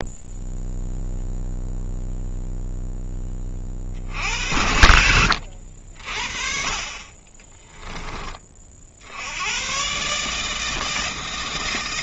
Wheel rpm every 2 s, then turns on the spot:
0, 0, 70, 40, 40, 160.
none